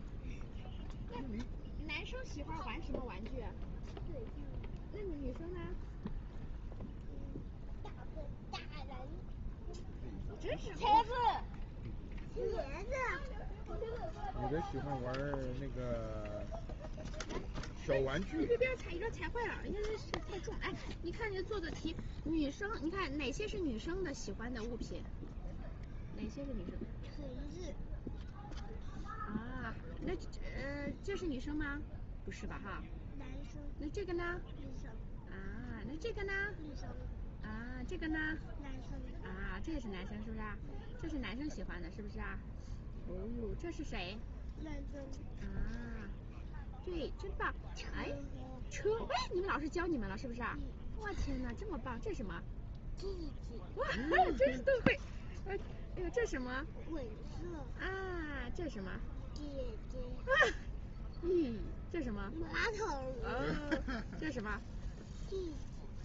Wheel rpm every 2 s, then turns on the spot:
0, 0, 0, 0, 0, 0, 0, 0, 0, 0, 0, 0, 0, 0, 0, 0, 0, 0, 0, 0, 0, 0, 0, 0, 0, 0, 0, 0, 0, 0, 0, 0, 0.
none